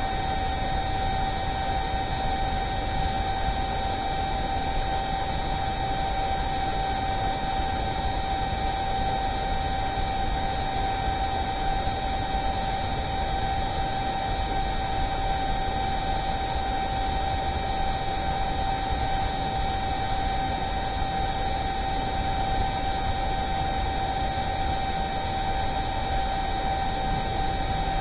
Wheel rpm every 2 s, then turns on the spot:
0, 0, 0, 0, 0, 0, 0, 0, 0, 0, 0, 0, 0, 0.
none